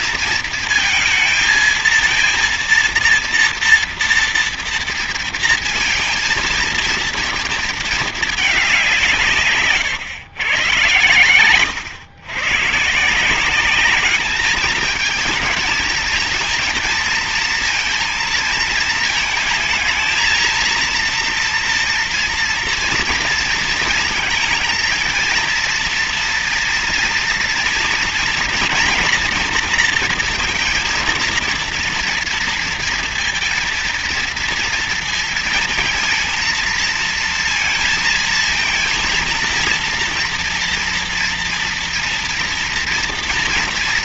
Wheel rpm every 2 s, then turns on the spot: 230, 230, 230, 230, 200, 110, 110, 210, 230, 230, 230, 240, 230, 230, 240, 230, 230, 230, 230, 230, 230, 230.
none